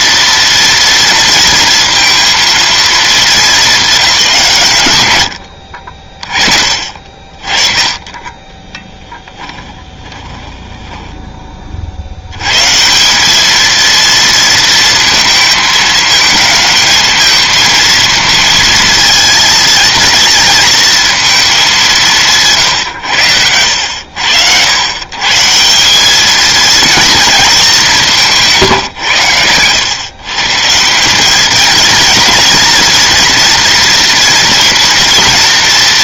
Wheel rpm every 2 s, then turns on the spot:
230, 230, 140, 40, 10, 10, 140, 230, 220, 220, 230, 140, 110, 220, 140, 160, 230, 240.
8-12